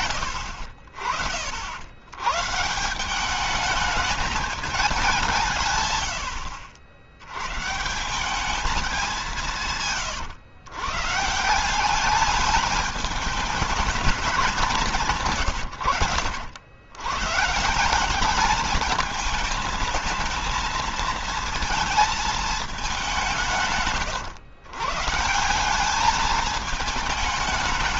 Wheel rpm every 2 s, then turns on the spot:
40, 180, 190, 80, 200, 130, 220, 160, 110, 210, 230, 190, 130, 220.
none